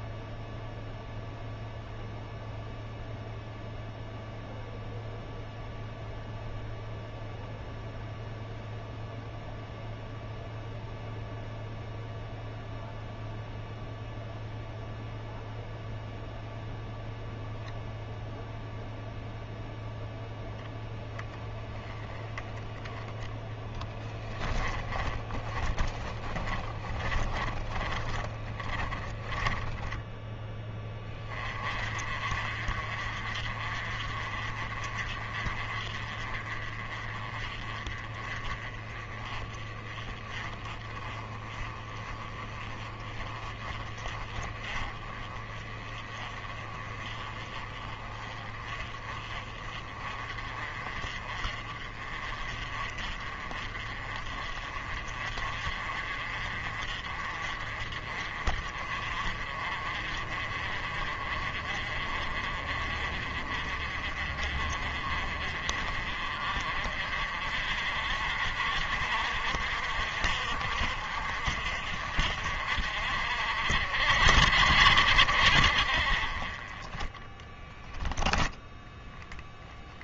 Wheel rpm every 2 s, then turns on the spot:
0, 0, 0, 0, 0, 0, 0, 0, 0, 0, 10, 20, 20, 20, 20, 20, 40, 40, 30, 30, 30, 30, 30, 30, 30, 40, 40, 40, 40, 40, 40, 40, 40, 50, 60, 50, 50, 70, 20, 10.
24-30